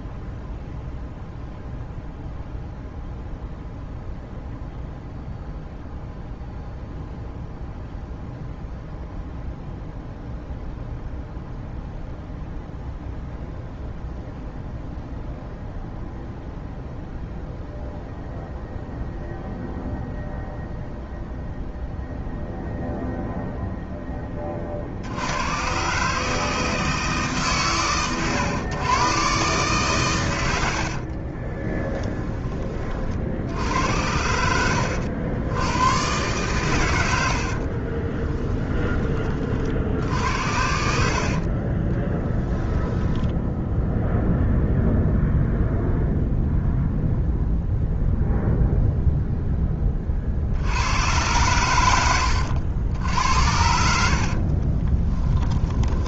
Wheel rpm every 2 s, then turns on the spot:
0, 0, 0, 0, 0, 0, 0, 0, 0, 0, 0, 0, 60, 160, 130, 70, 40, 80, 110, 20, 60, 10, 0, 0, 0, 80, 80, 20.
30-32 54-56